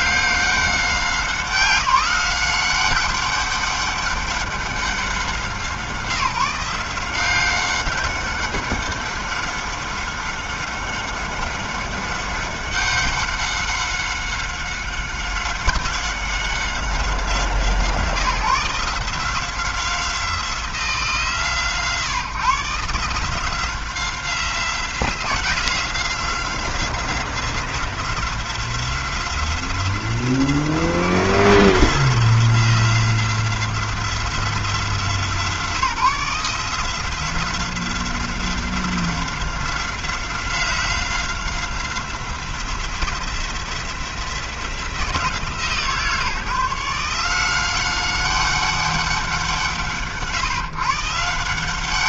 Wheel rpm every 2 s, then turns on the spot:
170, 190, 180, 190, 190, 190, 190, 190, 160, 170, 140, 170, 180, 180, 180, 180, 180, 160, 180, 180, 180, 180, 160, 180, 160, 170.
none